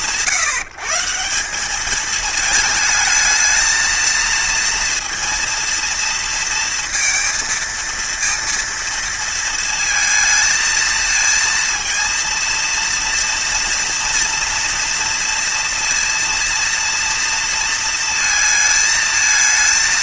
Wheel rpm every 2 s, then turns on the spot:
150, 220, 230, 230, 230, 220, 230, 230, 230, 220.
none